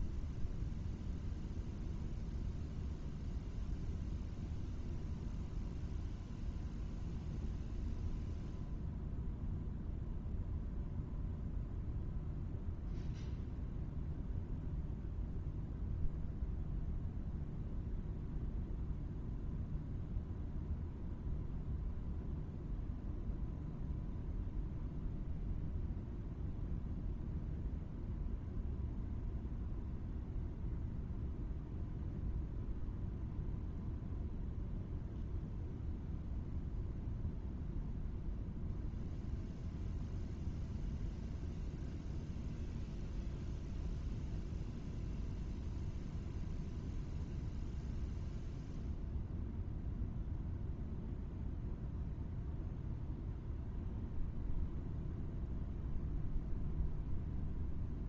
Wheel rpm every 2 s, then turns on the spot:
0, 0, 0, 0, 0, 0, 0, 0, 0, 0, 0, 0, 0, 0, 0, 0, 0, 0, 0, 0, 0, 0, 0, 0, 0, 0, 0, 0, 0.
none